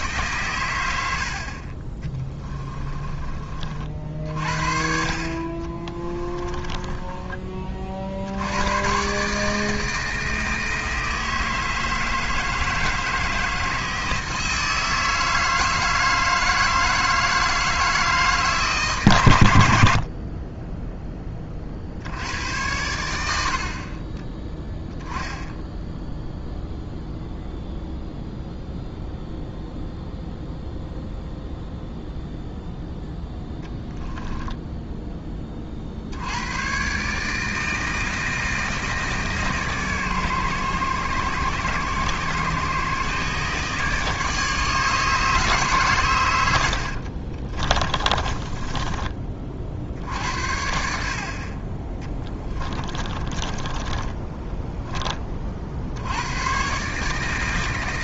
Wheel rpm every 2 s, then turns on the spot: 90, 30, 50, 20, 120, 160, 160, 160, 160, 140, 10, 100, 10, 0, 0, 0, 0, 10, 120, 160, 120, 140, 150, 70, 20, 60, 20, 10, 130.
2-4 6-8 46-50 52-54